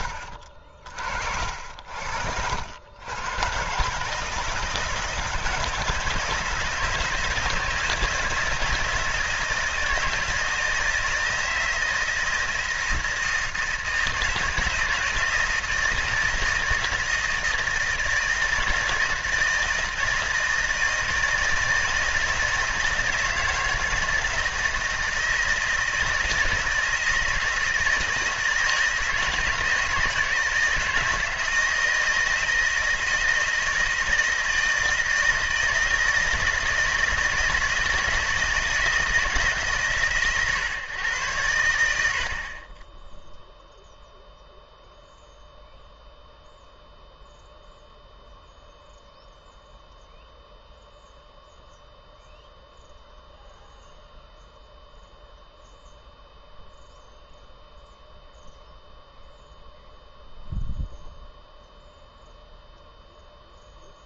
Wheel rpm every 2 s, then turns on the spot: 60, 90, 160, 160, 160, 160, 160, 160, 160, 160, 160, 160, 160, 160, 160, 160, 160, 160, 160, 160, 130, 30, 0, 0, 0, 0, 0, 0, 0, 0, 0, 0.
0-2